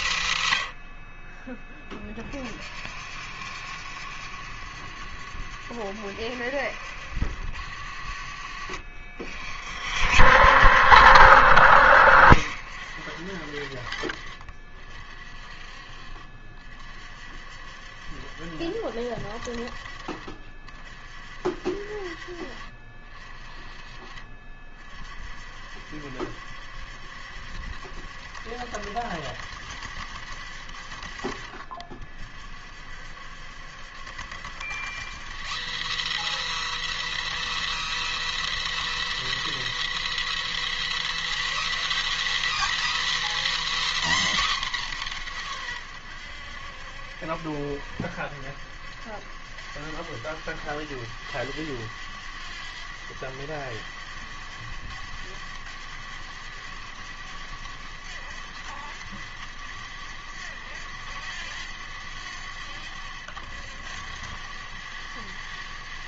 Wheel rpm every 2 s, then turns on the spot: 90, 60, 70, 80, 60, 80, 80, 50, 50, 60, 50, 50, 50, 70, 70, 60, 60, 130, 220, 210, 240, 300, 200, 70, 80, 100, 100, 100, 100, 100, 90, 90, 100.
none